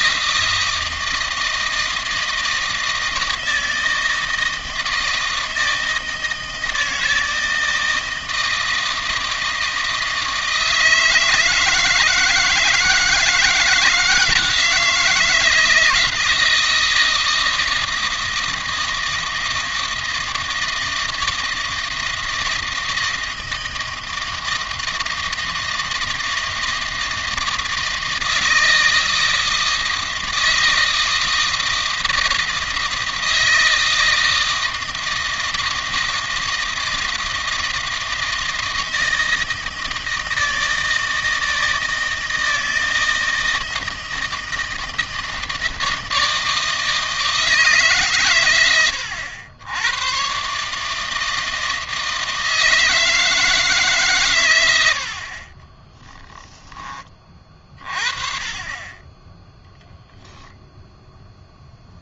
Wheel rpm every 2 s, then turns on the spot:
160, 160, 160, 160, 160, 160, 160, 160, 160, 160, 160, 160, 160, 160, 160, 160, 160, 160, 160, 160, 160, 160, 160, 160, 110, 130, 160, 120, 10, 30, 0.
none